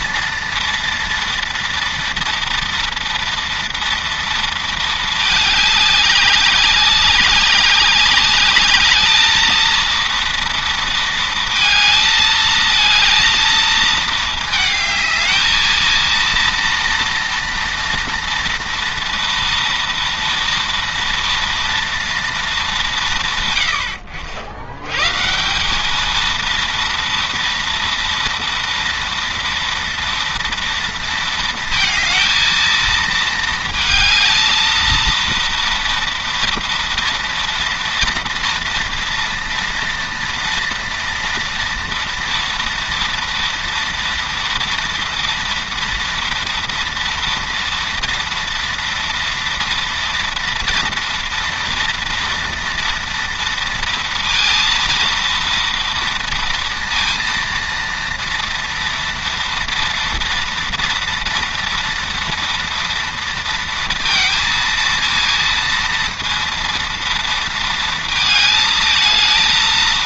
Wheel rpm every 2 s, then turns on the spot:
230, 230, 220, 200, 210, 230, 220, 220, 230, 230, 230, 200, 100, 230, 230, 230, 220, 220, 230, 230, 230, 230, 230, 230, 230, 230, 230, 230, 230, 230, 230, 230, 230, 230, 220.
none